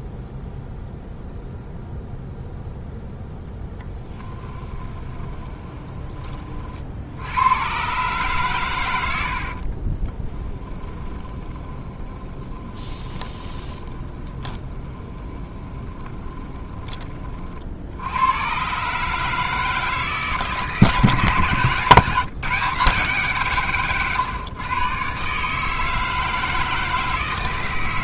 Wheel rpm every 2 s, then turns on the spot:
0, 0, 20, 60, 100, 20, 20, 20, 20, 140, 150, 160, 140, 160.
4-6 10-16